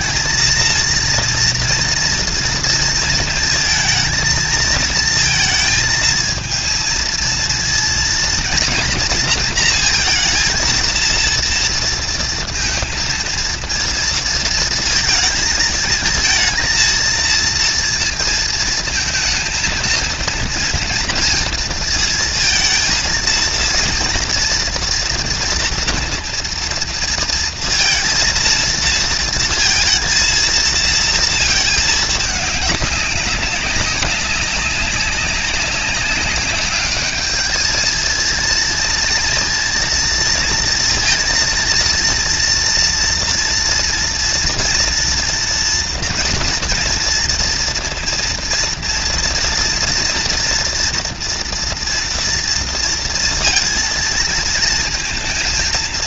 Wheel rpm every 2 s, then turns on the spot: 230, 220, 230, 230, 230, 230, 230, 230, 230, 220, 230, 230, 230, 230, 230, 230, 200, 200, 210, 230, 230, 230, 240, 230, 230, 230, 230, 230.
none